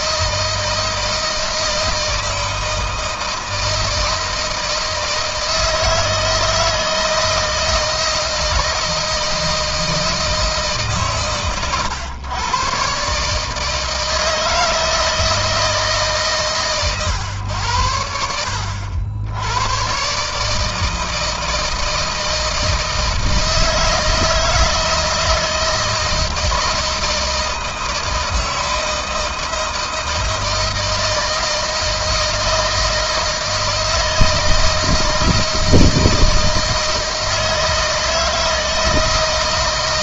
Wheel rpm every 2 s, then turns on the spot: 160, 160, 160, 160, 160, 150, 120, 160, 150, 80, 150, 160, 160, 160, 160, 160, 160, 160, 160, 160.
none